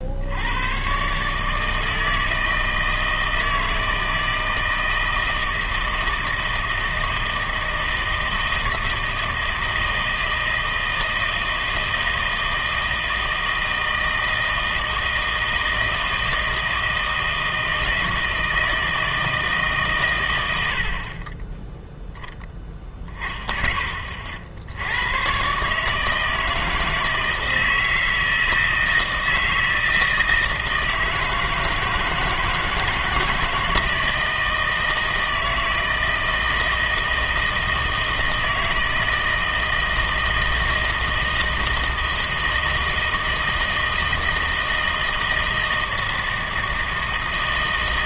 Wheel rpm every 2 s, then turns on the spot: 110, 160, 160, 160, 160, 160, 160, 160, 160, 160, 60, 0, 80, 160, 160, 160, 160, 160, 160, 160, 160, 160, 160, 160.
none